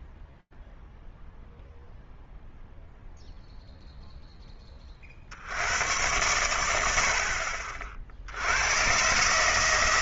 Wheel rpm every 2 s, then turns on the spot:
0, 0, 40, 80, 120.
none